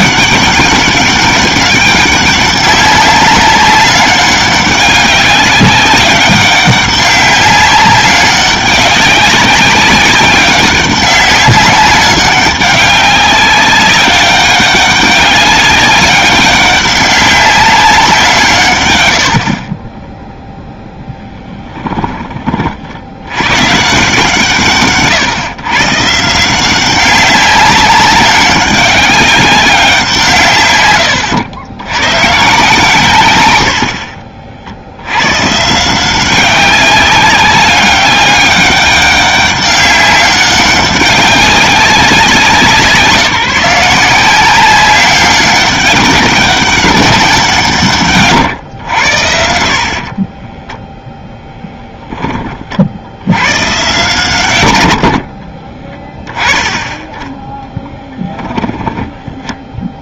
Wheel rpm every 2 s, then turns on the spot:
200, 200, 200, 200, 190, 190, 200, 200, 200, 120, 0, 50, 140, 180, 200, 110, 140, 80, 190, 200, 190, 170, 190, 200, 100, 0, 50, 90, 10, 10.
58-60